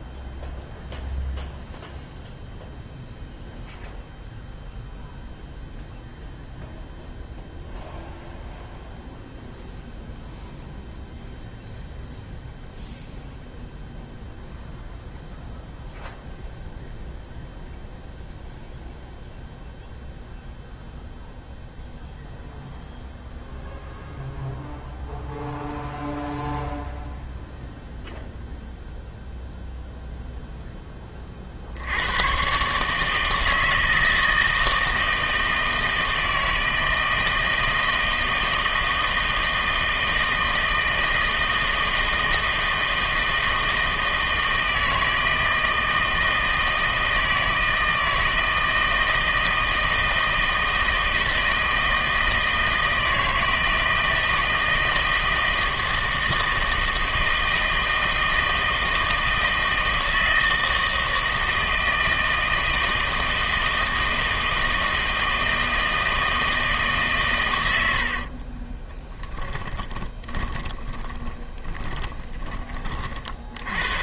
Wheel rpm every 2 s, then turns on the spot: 0, 0, 0, 0, 0, 0, 0, 0, 0, 0, 0, 0, 0, 0, 0, 10, 140, 160, 160, 160, 160, 160, 160, 160, 160, 160, 160, 160, 160, 160, 160, 160, 160, 150, 20, 30, 40.
68-72